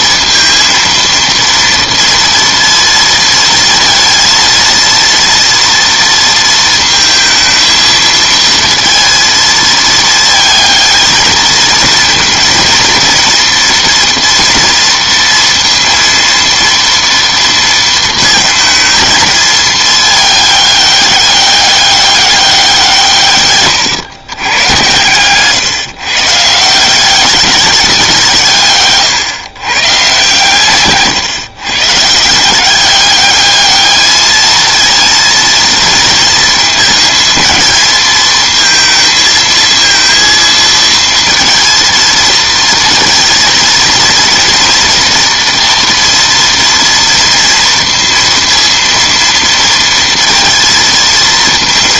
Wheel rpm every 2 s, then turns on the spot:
230, 230, 230, 230, 230, 220, 230, 230, 230, 220, 210, 190, 110, 160, 150, 140, 170, 220, 220, 220, 230, 230, 230, 230, 230, 230.
none